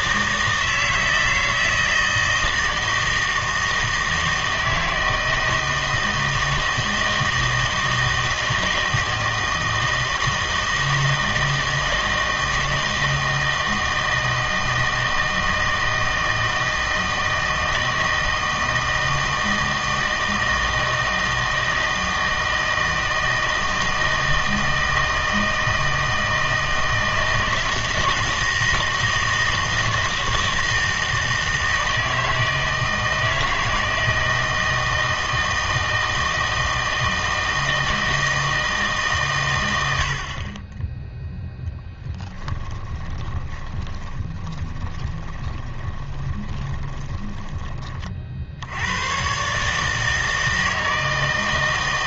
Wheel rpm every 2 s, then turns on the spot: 160, 160, 160, 160, 160, 160, 160, 160, 160, 160, 160, 160, 160, 160, 160, 160, 160, 160, 160, 160, 20, 30, 20, 20, 80, 160.
42-48